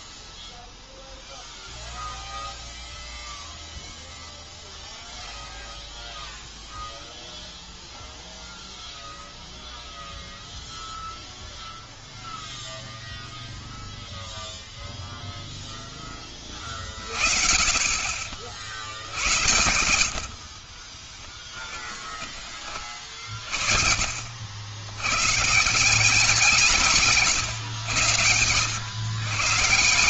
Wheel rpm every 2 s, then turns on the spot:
0, 0, 0, 0, 0, 0, 0, 0, 20, 60, 60, 30, 70, 170, 110.
20-22